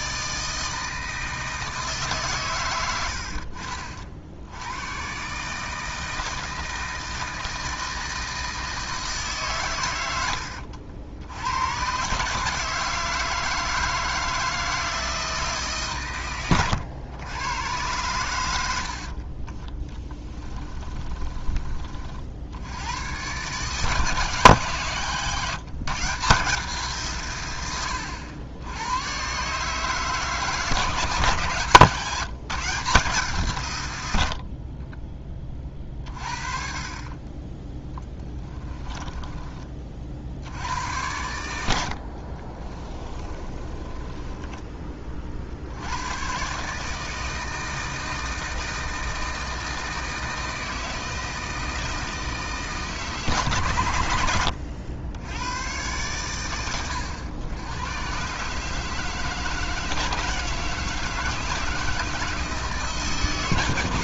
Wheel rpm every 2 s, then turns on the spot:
160, 90, 110, 160, 160, 80, 160, 160, 100, 80, 30, 100, 150, 160, 100, 160, 170, 40, 30, 20, 90, 40, 20, 150, 160, 160, 160, 90, 100, 150, 160, 150.
20-22 38-40 42-44